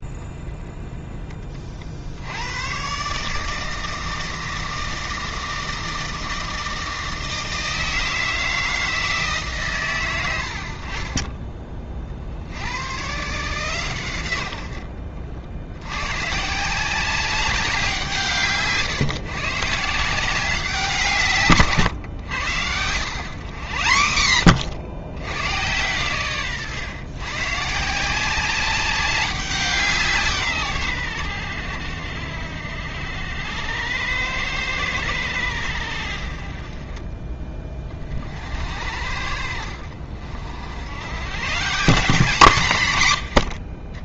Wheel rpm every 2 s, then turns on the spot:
20, 120, 160, 160, 160, 40, 120, 60, 180, 140, 170, 100, 100, 130, 190, 100, 70, 100, 30, 70, 90, 110.
none